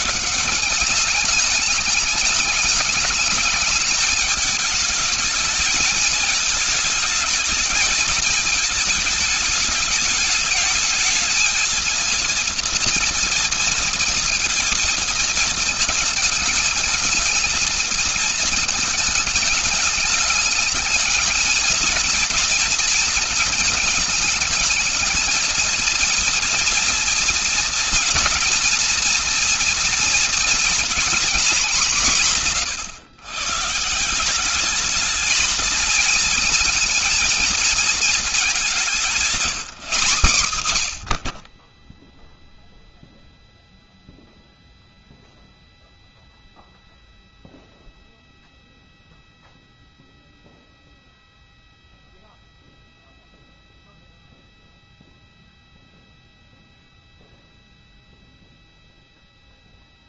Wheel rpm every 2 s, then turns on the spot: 210, 210, 220, 220, 220, 210, 230, 220, 210, 220, 210, 230, 220, 230, 230, 230, 130, 200, 230, 200, 130, 0, 0, 0, 0, 0, 0, 0, 0, 0.
none